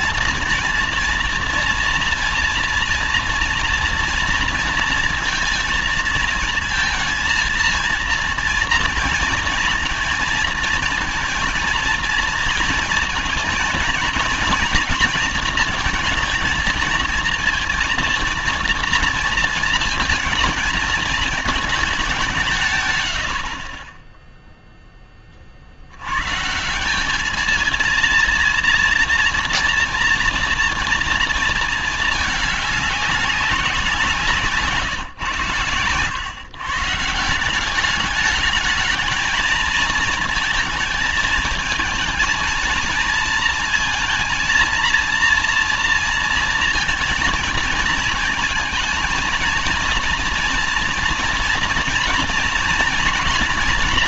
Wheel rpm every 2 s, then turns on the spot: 230, 230, 230, 220, 230, 230, 230, 240, 230, 230, 230, 150, 0, 160, 230, 230, 210, 160, 130, 220, 220, 220, 230, 230, 230, 230, 220.
none